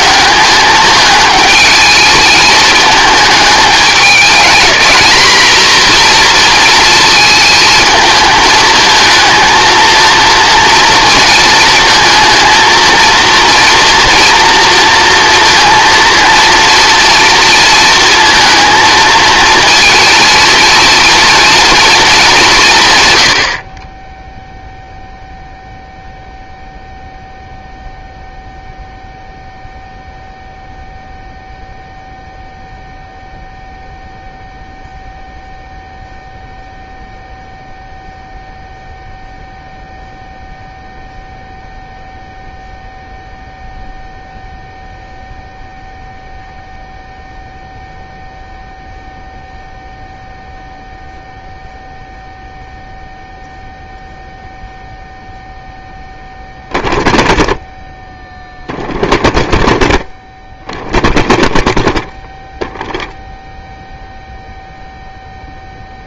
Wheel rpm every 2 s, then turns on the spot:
210, 220, 220, 230, 220, 230, 230, 240, 230, 220, 230, 170, 0, 0, 0, 0, 0, 0, 0, 0, 0, 0, 0, 0, 0, 0, 0, 0, 0, 0, 0, 0, 0.
none